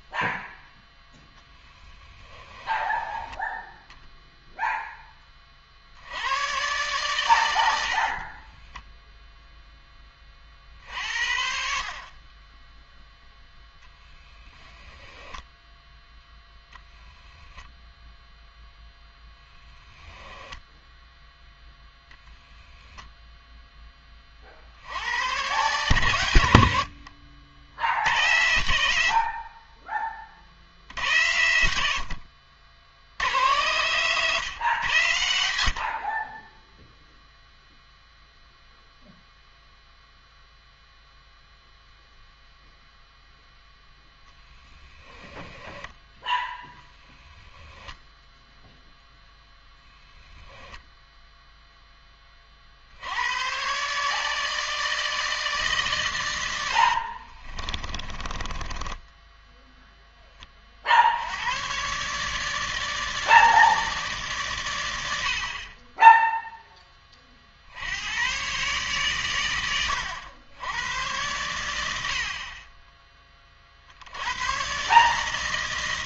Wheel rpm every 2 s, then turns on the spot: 0, 10, 0, 110, 30, 40, 20, 10, 0, 0, 10, 0, 40, 90, 100, 60, 60, 130, 30, 0, 0, 0, 20, 10, 0, 10, 40, 150, 90, 20, 20, 150, 120, 0, 120, 90, 40, 110.
2-4 8-10 44-46 58-60